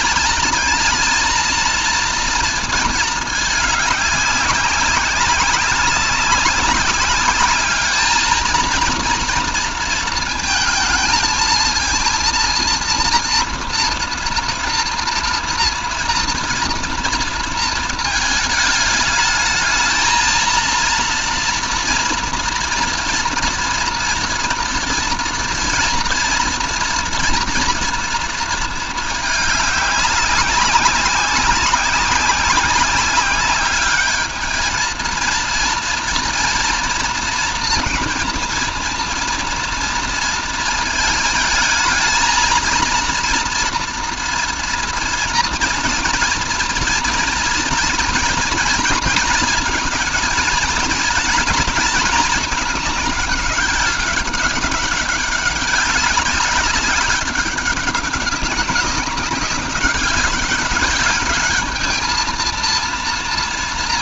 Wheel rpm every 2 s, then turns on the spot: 230, 230, 190, 190, 230, 230, 230, 230, 230, 220, 230, 240, 230, 230, 220, 190, 190, 220, 230, 230, 220, 230, 230, 230, 240, 220, 210, 200, 190, 190, 200, 230.
none